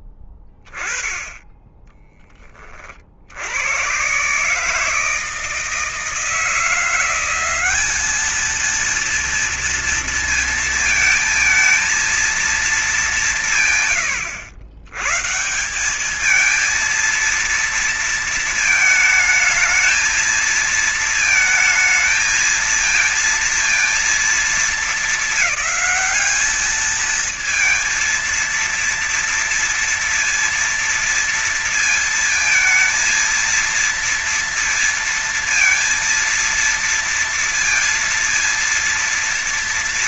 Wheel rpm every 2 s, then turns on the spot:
10, 20, 140, 170, 220, 230, 220, 110, 210, 230, 220, 220, 220, 210, 230, 230, 230, 230, 230, 230.
none